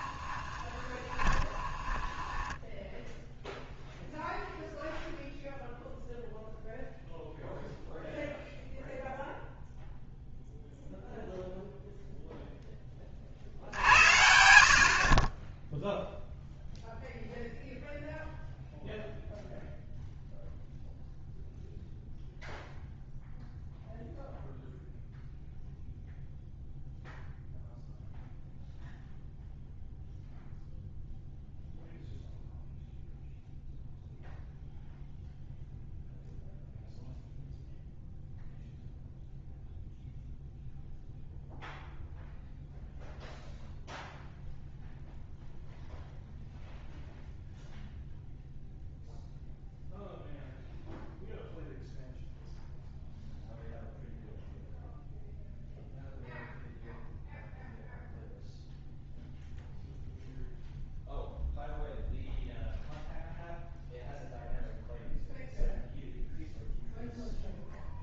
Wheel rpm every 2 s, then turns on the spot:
20, 10, 0, 0, 0, 0, 10, 70, 0, 0, 0, 0, 0, 0, 0, 0, 0, 0, 0, 0, 0, 0, 0, 0, 0, 0, 0, 0, 0, 0, 0, 0, 0, 0.
0-4